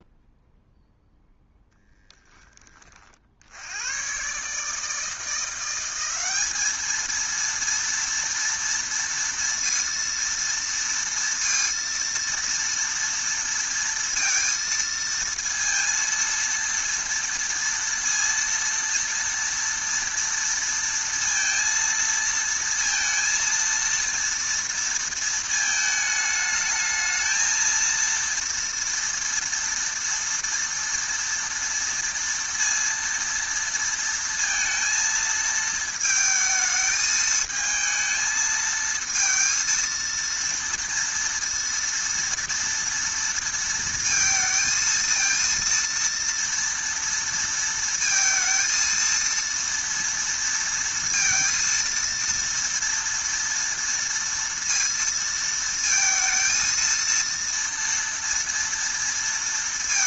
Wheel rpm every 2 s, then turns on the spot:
0, 50, 160, 220, 230, 230, 230, 230, 230, 230, 230, 230, 230, 220, 230, 230, 230, 230, 220, 220, 230, 230, 230, 230, 230, 230, 230, 230, 230, 230.
none